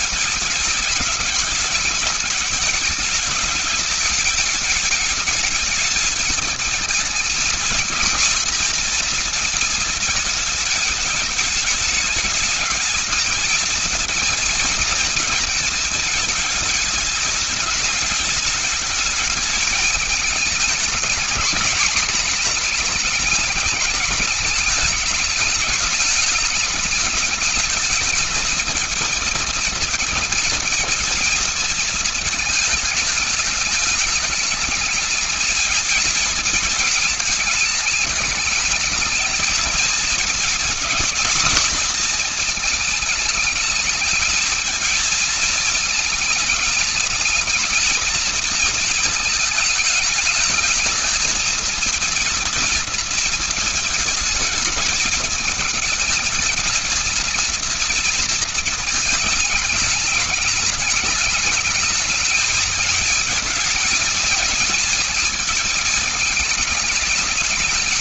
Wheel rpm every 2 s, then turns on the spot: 210, 210, 210, 220, 230, 210, 220, 220, 210, 220, 210, 210, 210, 210, 220, 230, 210, 220, 220, 220, 240, 210, 220, 220, 220, 220, 240, 210, 220, 220, 220, 220, 220, 220.
none